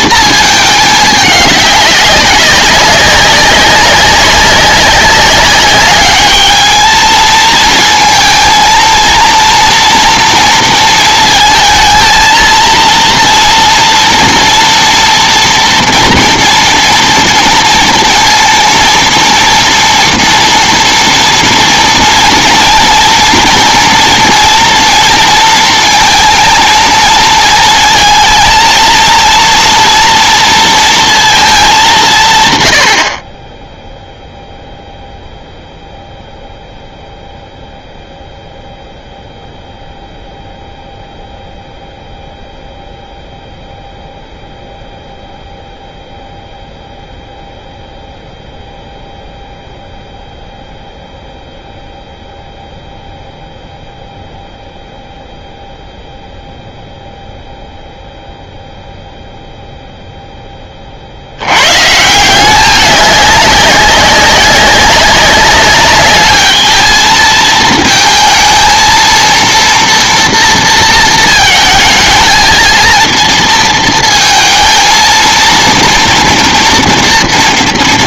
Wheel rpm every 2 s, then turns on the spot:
220, 200, 200, 220, 230, 230, 230, 230, 230, 230, 230, 230, 230, 230, 230, 230, 120, 0, 0, 0, 0, 0, 0, 0, 0, 0, 0, 0, 0, 0, 20, 200, 190, 220, 230, 230, 220, 230, 230.
none